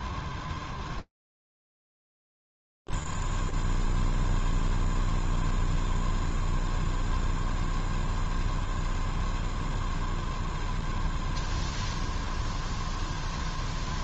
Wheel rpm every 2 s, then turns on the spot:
0, 0, 0, 0, 0, 0, 0.
none